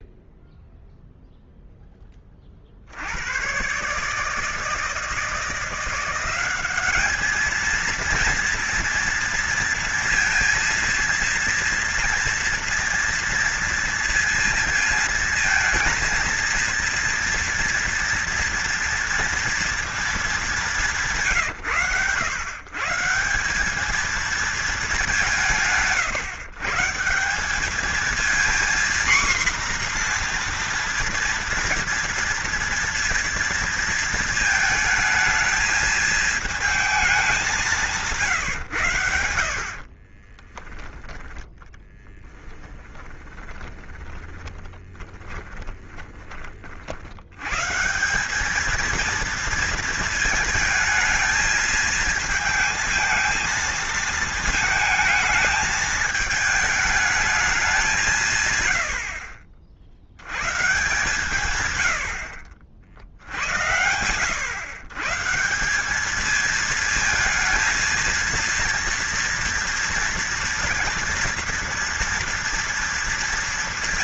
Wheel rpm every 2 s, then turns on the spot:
0, 70, 160, 200, 230, 230, 230, 230, 230, 230, 170, 150, 200, 160, 240, 230, 230, 220, 210, 90, 10, 10, 30, 60, 220, 220, 230, 220, 220, 100, 140, 60, 130, 220, 230, 230, 230.
40-46